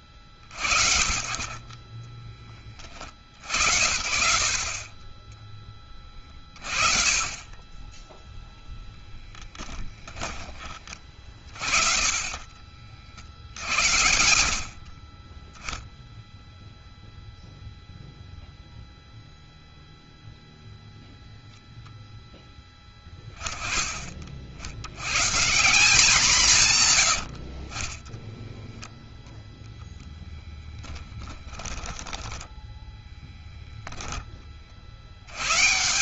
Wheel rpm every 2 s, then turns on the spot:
40, 20, 60, 30, 0, 10, 20, 60, 0, 0, 0, 0, 50, 170, 10, 0, 10, 20.
12-14 28-30 32-34